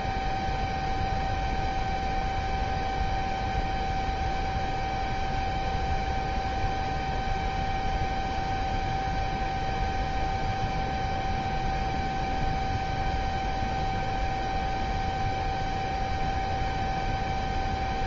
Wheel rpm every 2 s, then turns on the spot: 0, 0, 0, 0, 0, 0, 0, 0, 0.
none